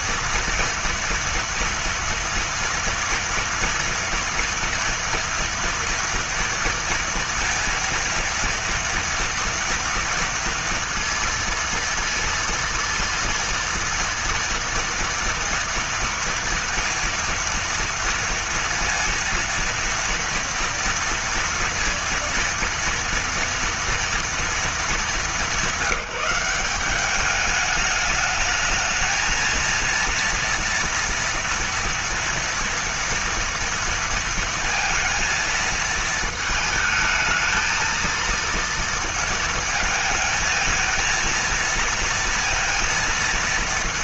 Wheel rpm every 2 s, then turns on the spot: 230, 230, 230, 230, 230, 230, 230, 230, 230, 230, 230, 230, 220, 190, 210, 230, 240, 230, 220, 230, 220, 230.
none